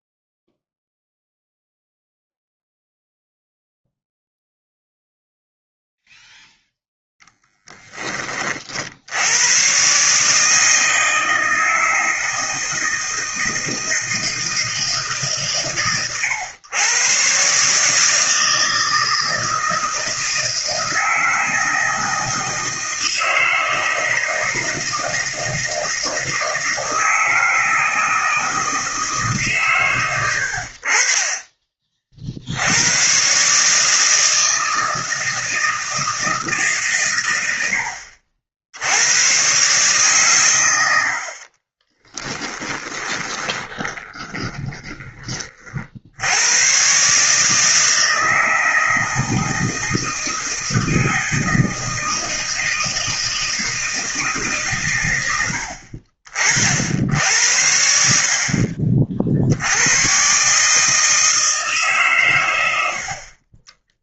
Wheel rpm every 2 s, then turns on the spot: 0, 0, 0, 0, 40, 150, 160, 160, 110, 160, 160, 160, 160, 160, 160, 70, 60, 160, 150, 60, 110, 10, 20, 110, 160, 160, 160, 140, 50, 50, 140, 110.
42-46